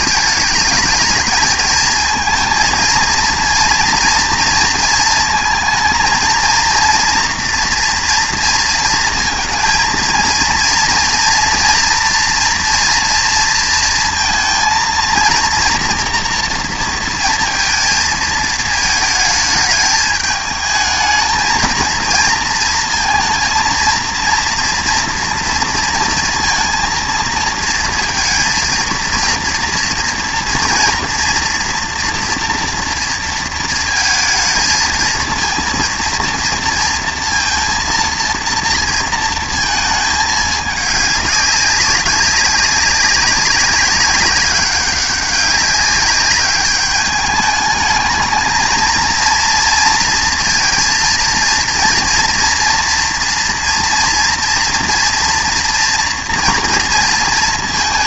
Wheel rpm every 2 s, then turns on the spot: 210, 230, 230, 230, 230, 230, 230, 230, 230, 220, 220, 230, 230, 230, 230, 230, 230, 220, 230, 230, 210, 200, 200, 200, 230, 230, 240, 230, 230.
none